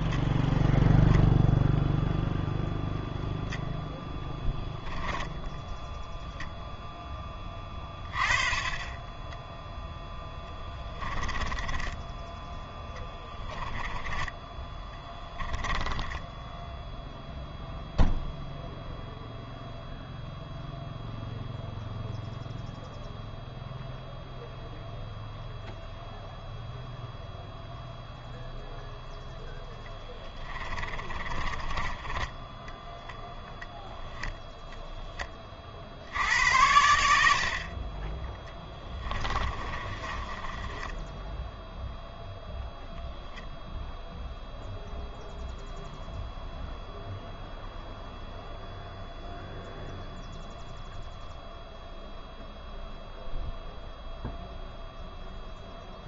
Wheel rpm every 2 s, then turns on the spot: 0, 0, 10, 0, 20, 10, 10, 10, 0, 0, 0, 0, 0, 0, 0, 20, 10, 0, 80, 20, 10, 0, 0, 0, 0, 0, 0, 0.
10-14 30-34 38-42